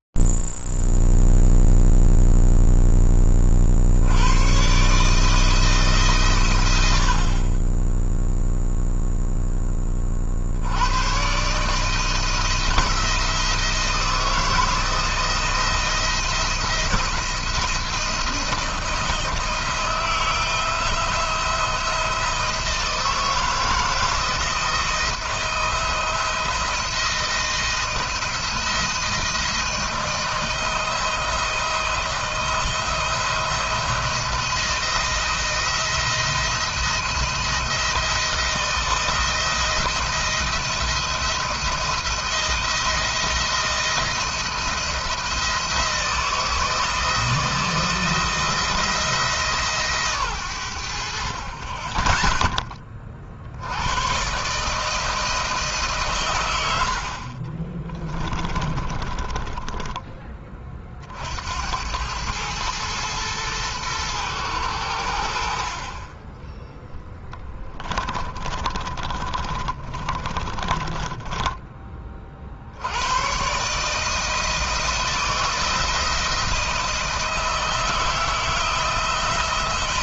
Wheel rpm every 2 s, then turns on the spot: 0, 0, 60, 150, 20, 30, 160, 170, 170, 170, 160, 170, 170, 170, 170, 160, 170, 170, 170, 160, 170, 170, 170, 160, 170, 90, 30, 150, 80, 20, 40, 110, 100, 10, 40, 30, 60, 160, 160, 160.
56-60 68-72